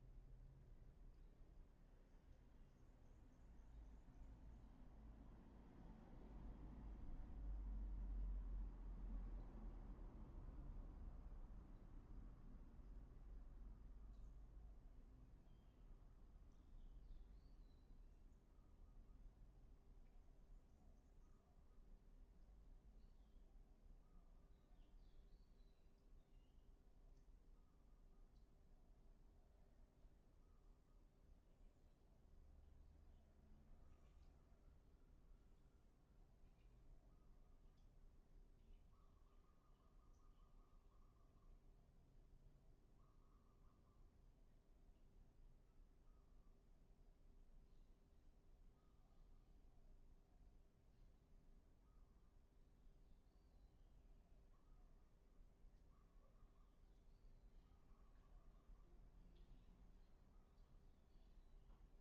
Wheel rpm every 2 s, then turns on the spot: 0, 0, 0, 0, 0, 0, 0, 0, 0, 0, 0, 0, 0, 0, 0, 0, 0, 0, 0, 0, 0, 0, 0, 0, 0, 0, 0, 0, 0, 0, 0.
none